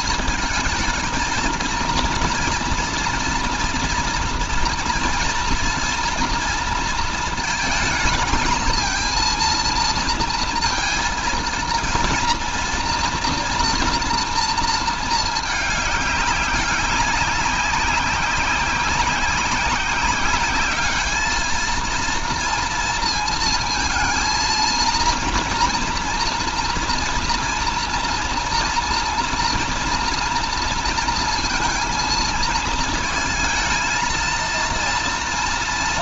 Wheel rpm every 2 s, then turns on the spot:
220, 240, 230, 230, 220, 230, 240, 220, 190, 190, 200, 230, 230, 230, 230, 230, 230, 230.
none